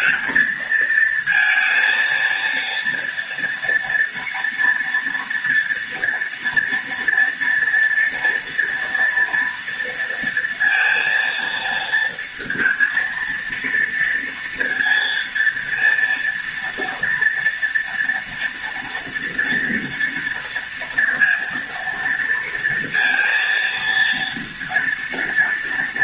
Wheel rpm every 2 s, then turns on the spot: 220, 230, 230, 230, 240, 230, 230, 230, 230, 230, 230, 230, 230.
none